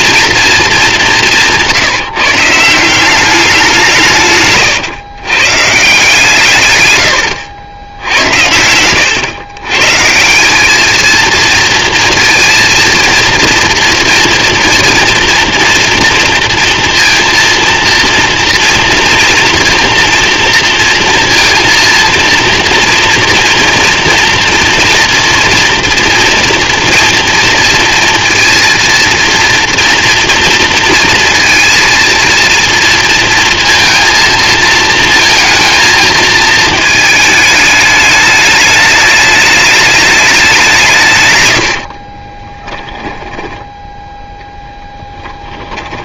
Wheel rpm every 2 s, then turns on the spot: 200, 160, 120, 120, 100, 220, 230, 240, 240, 240, 230, 230, 230, 230, 230, 230, 230, 220, 220, 220, 170, 10, 0.
42-44